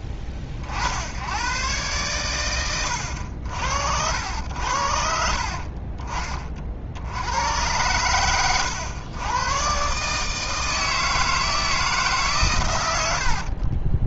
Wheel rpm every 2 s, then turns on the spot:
30, 100, 70, 40, 100, 150, 130.
8-10